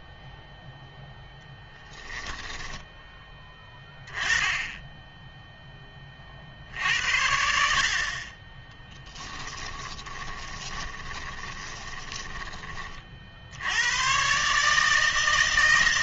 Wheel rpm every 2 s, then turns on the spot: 0, 10, 20, 60, 20, 20, 20, 140.
2-4 10-12